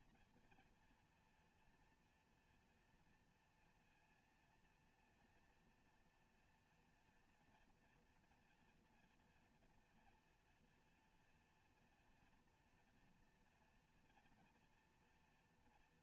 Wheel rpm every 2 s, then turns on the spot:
240, 230, 230, 230, 240, 240, 230, 230.
none